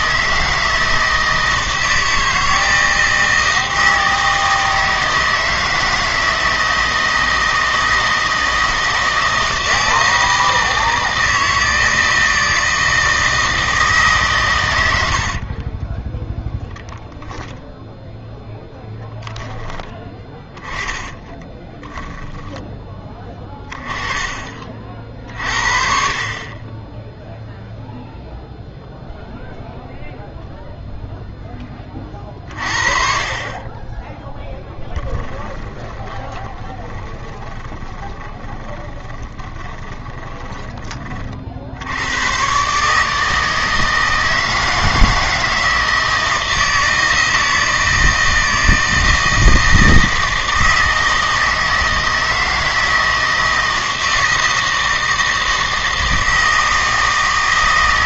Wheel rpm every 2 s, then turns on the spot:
160, 160, 160, 160, 160, 160, 160, 90, 0, 10, 10, 10, 30, 20, 0, 0, 40, 10, 20, 20, 20, 140, 160, 160, 160, 160, 160, 160, 160.
20-22 34-40